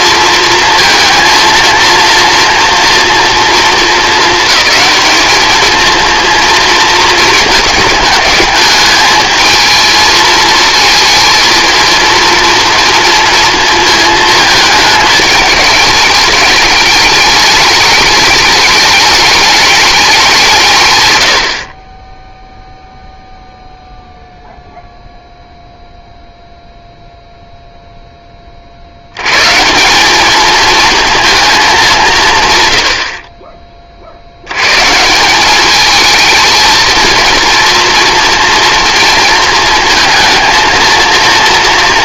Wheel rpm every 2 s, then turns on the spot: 230, 230, 220, 230, 220, 230, 230, 210, 210, 210, 130, 0, 0, 0, 30, 220, 150, 90, 230, 230, 230.
none